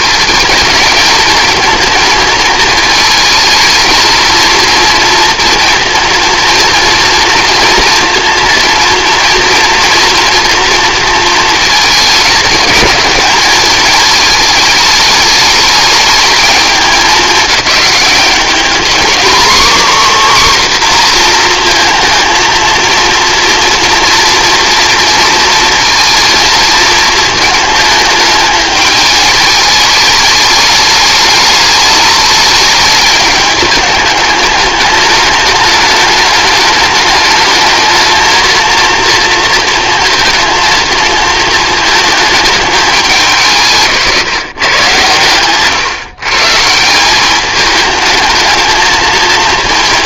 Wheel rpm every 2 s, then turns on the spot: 220, 220, 230, 230, 230, 230, 220, 210, 210, 220, 260, 230, 230, 230, 210, 210, 210, 210, 210, 230, 230, 210, 140, 150, 220.
none